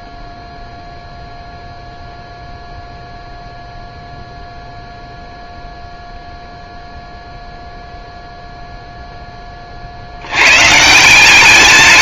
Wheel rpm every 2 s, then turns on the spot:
0, 0, 0, 0, 0, 150.
none